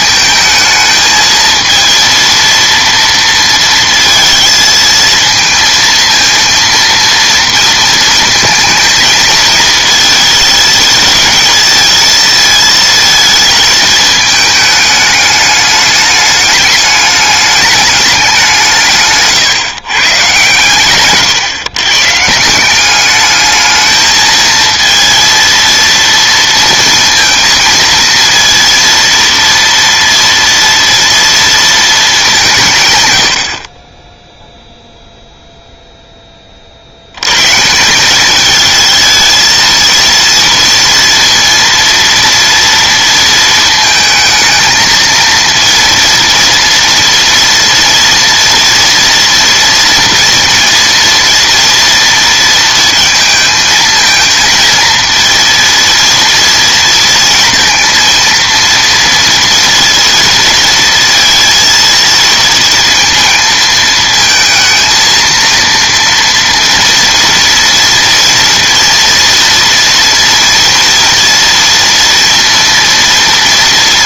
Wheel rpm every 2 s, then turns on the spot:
220, 230, 230, 230, 220, 220, 220, 210, 210, 180, 130, 170, 230, 230, 230, 230, 170, 0, 50, 220, 230, 230, 220, 230, 230, 230, 230, 230, 230, 230, 230, 230, 230, 230, 230, 230, 230.
none